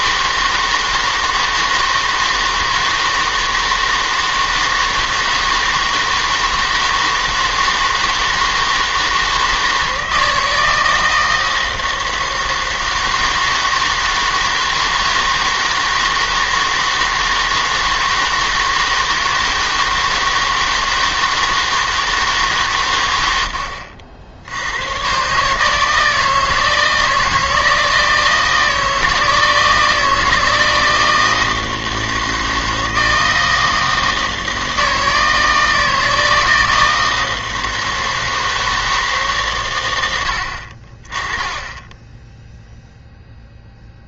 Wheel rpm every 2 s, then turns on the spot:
160, 160, 160, 160, 160, 160, 160, 160, 160, 160, 160, 130, 100, 160, 160, 160, 160, 160, 160, 160, 60, 0.
none